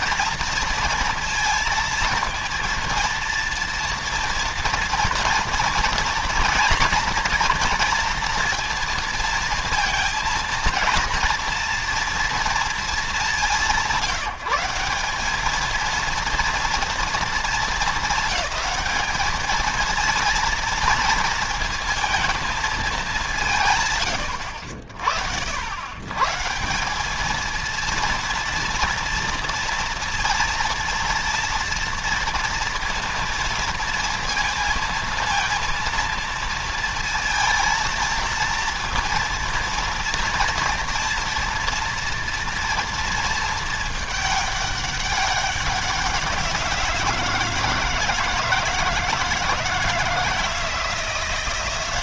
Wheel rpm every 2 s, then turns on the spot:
230, 230, 230, 230, 230, 230, 230, 160, 230, 210, 230, 220, 70, 150, 230, 230, 230, 230, 230, 230, 230, 230, 210, 180, 160, 160.
none